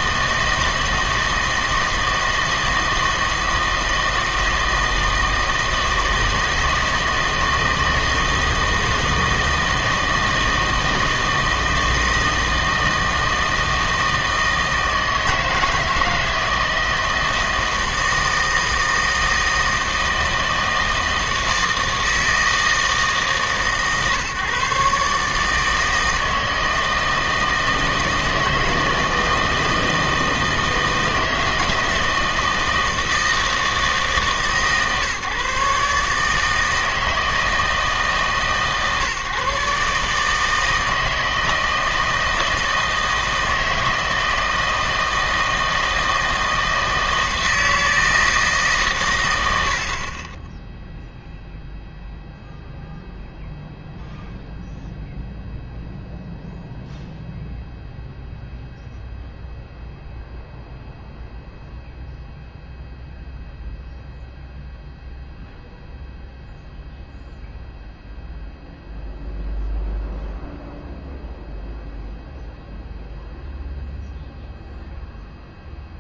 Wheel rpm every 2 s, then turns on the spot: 160, 160, 160, 160, 160, 160, 160, 160, 160, 160, 160, 160, 140, 160, 160, 160, 160, 140, 160, 140, 160, 160, 160, 160, 140, 0, 0, 0, 0, 0, 0, 0, 0, 0, 0, 0, 0, 0.
none